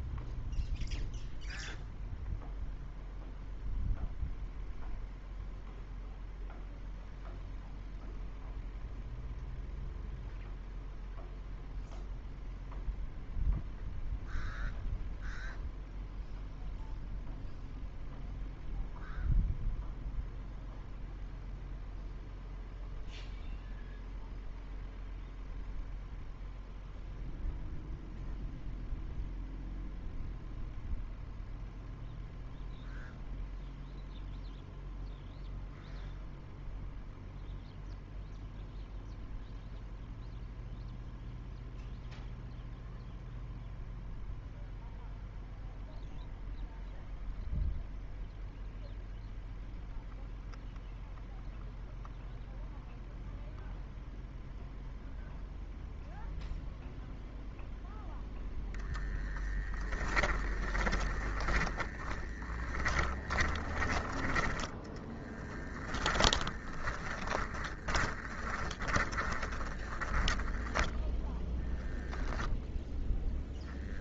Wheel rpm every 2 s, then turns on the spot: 0, 0, 0, 0, 0, 0, 0, 0, 0, 0, 0, 0, 0, 0, 0, 0, 0, 0, 0, 0, 0, 0, 0, 0, 0, 0, 0, 0, 0, 10, 20, 30, 20, 10, 20, 20, 0.
58-64 66-72